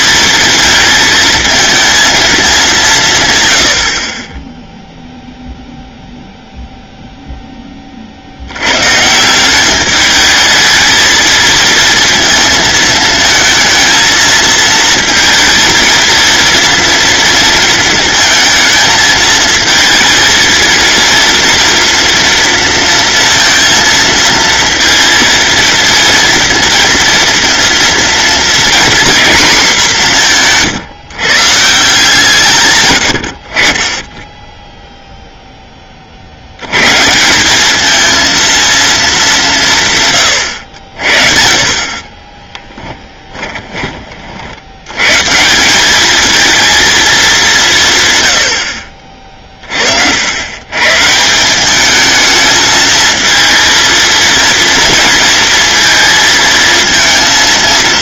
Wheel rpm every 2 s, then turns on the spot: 230, 180, 0, 0, 120, 220, 220, 220, 230, 230, 230, 230, 230, 230, 240, 150, 120, 0, 120, 220, 60, 10, 100, 220, 60, 130, 220, 230, 220.
42-44